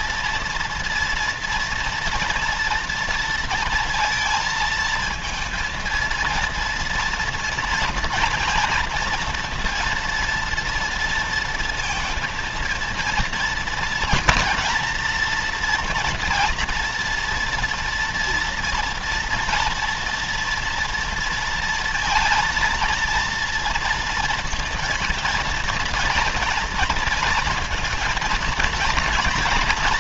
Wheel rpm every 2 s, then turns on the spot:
230, 230, 220, 230, 230, 230, 230, 230, 230, 240, 230, 230, 230, 230, 230.
none